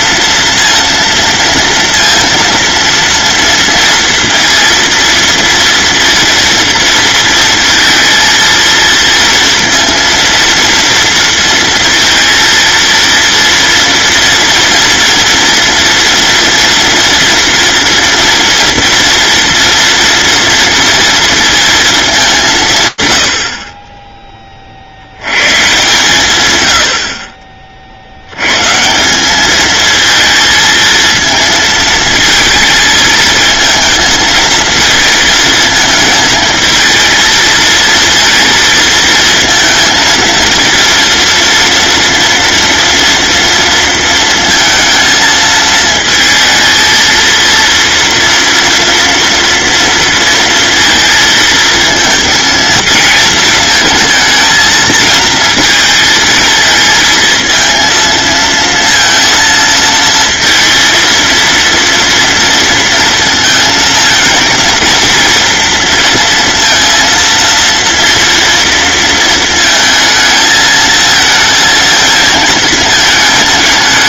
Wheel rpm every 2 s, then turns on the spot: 230, 230, 230, 230, 230, 230, 230, 230, 230, 230, 230, 160, 50, 90, 160, 230, 220, 230, 220, 230, 230, 230, 230, 230, 230, 230, 220, 220, 220, 230, 230, 230, 230, 230, 230, 220, 220.
none